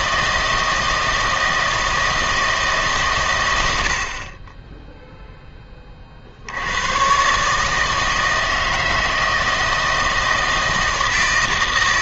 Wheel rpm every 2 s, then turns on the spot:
160, 150, 10, 90, 160, 160.
none